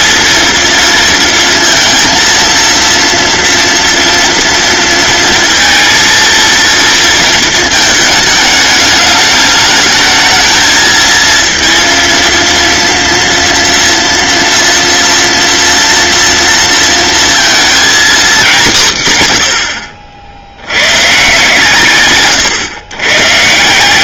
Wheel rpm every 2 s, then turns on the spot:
230, 230, 230, 230, 210, 220, 230, 230, 230, 150, 110, 120.
none